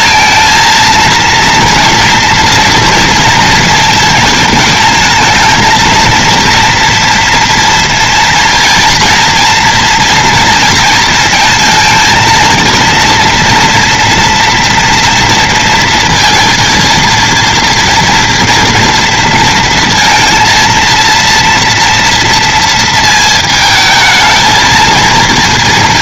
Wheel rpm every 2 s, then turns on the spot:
230, 230, 220, 230, 230, 230, 230, 230, 230, 230, 230, 230, 230.
none